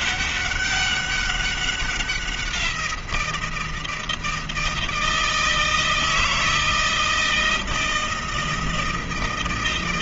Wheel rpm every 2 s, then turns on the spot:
200, 170, 160, 160, 160.
none